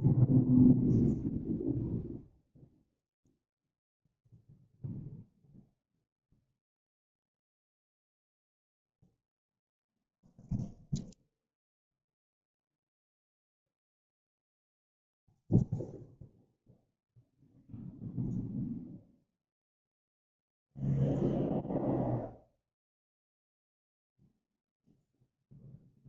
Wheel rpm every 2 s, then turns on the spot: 0, 0, 0, 0, 0, 0, 0, 0, 0, 0, 0, 0, 0.
none